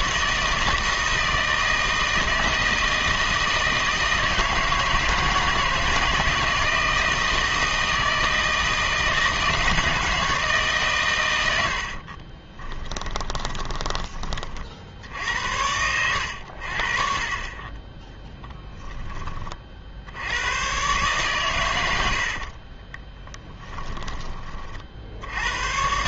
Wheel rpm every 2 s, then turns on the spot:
160, 160, 160, 160, 160, 150, 20, 50, 70, 10, 110, 50, 30.
12-14 22-24